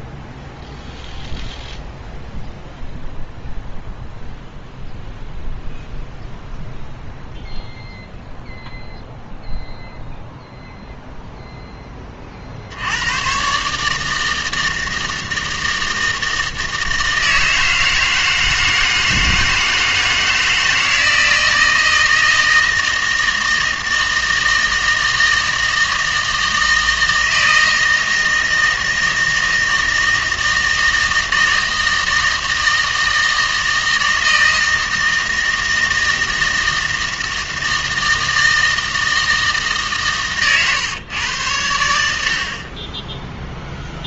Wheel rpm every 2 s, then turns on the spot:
0, 0, 0, 0, 0, 0, 80, 160, 160, 160, 160, 160, 160, 160, 160, 160, 160, 160, 160, 160, 130, 20.
none